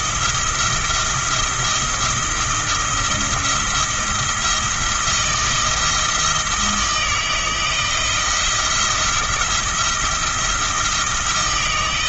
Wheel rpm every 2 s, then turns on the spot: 170, 170, 170, 160, 170, 160.
none